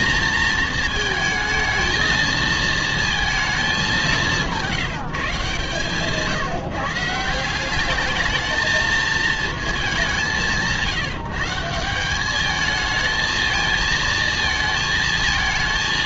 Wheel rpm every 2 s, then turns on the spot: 220, 230, 170, 150, 220, 140, 210, 230.
none